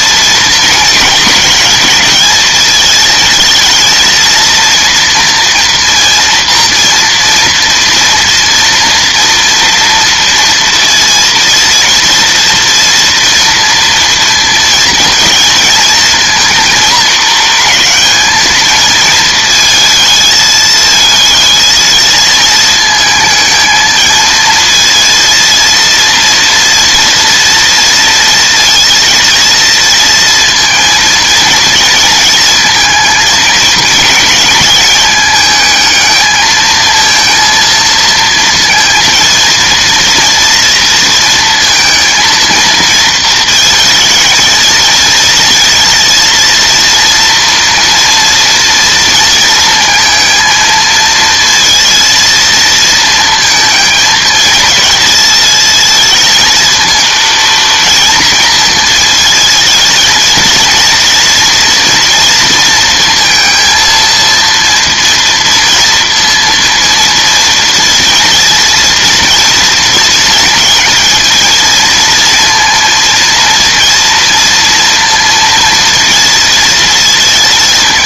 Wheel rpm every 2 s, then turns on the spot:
220, 220, 230, 240, 230, 230, 230, 230, 220, 220, 220, 220, 230, 230, 230, 230, 220, 220, 220, 230, 230, 230, 230, 230, 230, 230, 230, 220, 230, 230, 230, 230, 230, 230, 230, 220, 230, 230, 230.
none